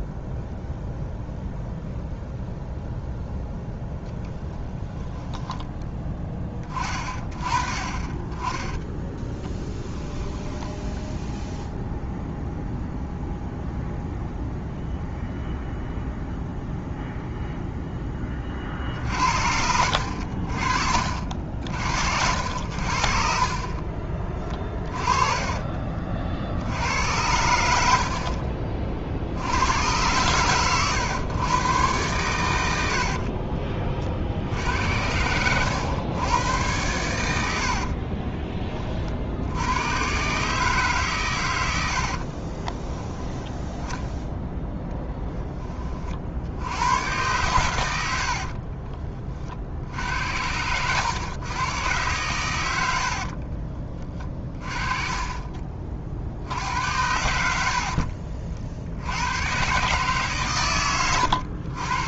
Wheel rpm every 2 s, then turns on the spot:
0, 0, 10, 30, 10, 0, 0, 0, 0, 50, 60, 60, 30, 80, 40, 110, 80, 80, 100, 40, 150, 20, 0, 90, 30, 100, 80, 30, 80, 70, 110.
24-26 32-34 42-44 48-50 52-54